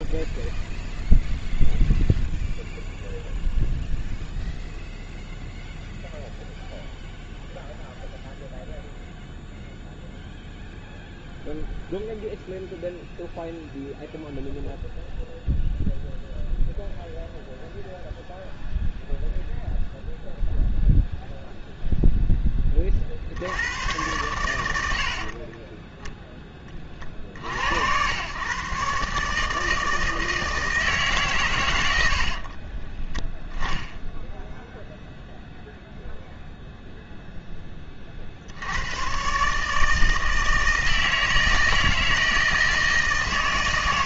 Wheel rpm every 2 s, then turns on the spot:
0, 0, 0, 0, 0, 0, 0, 0, 0, 0, 0, 10, 100, 20, 130, 160, 40, 0, 0, 80, 160, 160.
32-34